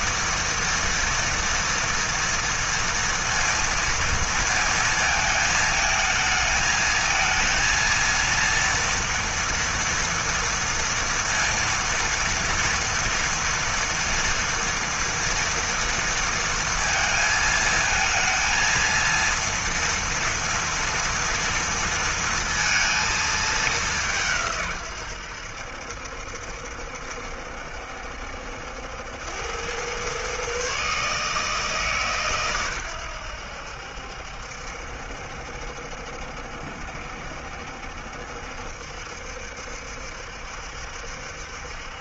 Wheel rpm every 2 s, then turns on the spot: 230, 230, 220, 220, 230, 230, 230, 230, 230, 230, 240, 220, 110, 70, 80, 140, 110, 70, 70, 70, 70.
none